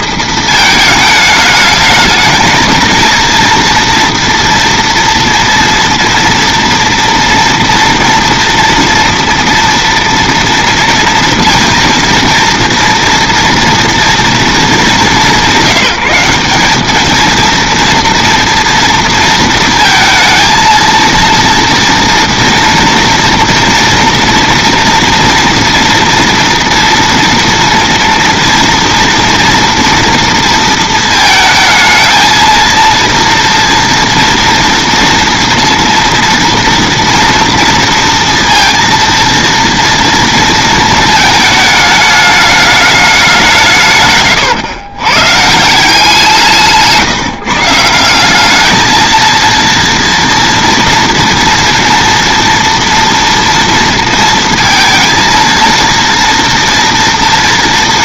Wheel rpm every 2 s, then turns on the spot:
220, 220, 230, 230, 230, 230, 230, 220, 210, 230, 230, 230, 230, 230, 230, 230, 230, 230, 230, 230, 230, 210, 130, 160, 210, 240, 230, 230, 230.
none